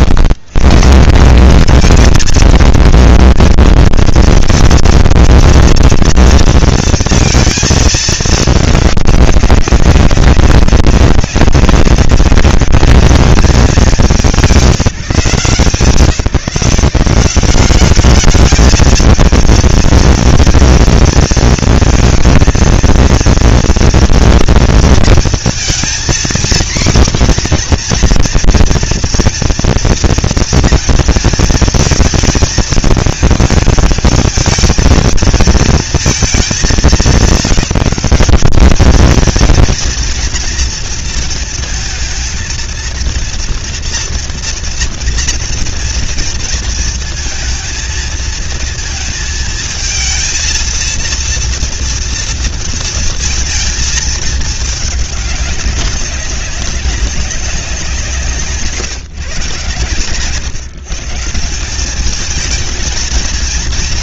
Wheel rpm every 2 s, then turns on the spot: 90, 220, 230, 230, 210, 200, 190, 170, 160, 210, 230, 230, 230, 260, 240, 230, 220, 220, 190, 210, 230, 230, 230, 230, 230, 230, 230, 210, 190, 170, 140, 220.
58-60